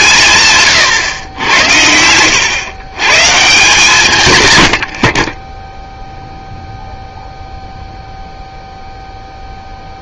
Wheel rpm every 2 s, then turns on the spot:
130, 120, 90, 0, 0.
none